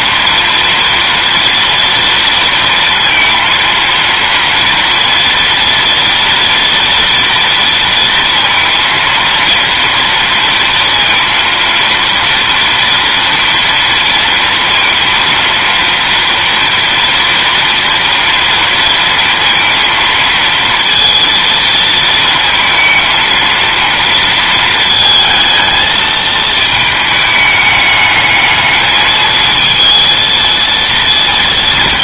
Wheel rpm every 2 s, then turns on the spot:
230, 230, 230, 230, 230, 230, 230, 230, 230, 230, 230, 230, 230, 220, 220, 230.
none